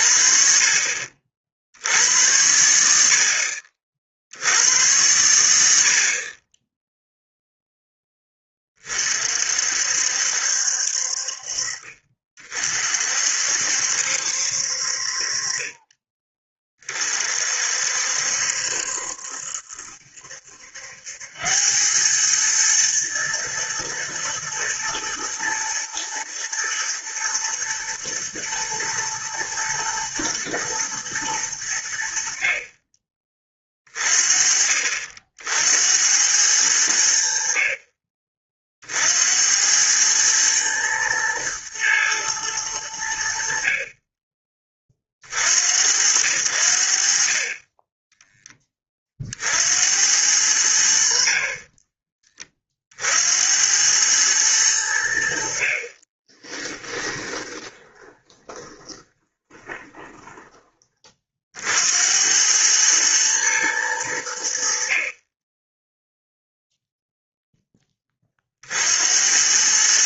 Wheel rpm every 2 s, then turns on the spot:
40, 80, 90, 30, 20, 60, 40, 60, 20, 70, 70, 110, 110, 120, 110, 110, 40, 40, 90, 40, 110, 110, 30, 70, 20, 80, 30, 100, 20, 20, 20, 100, 70, 0, 50.
56-60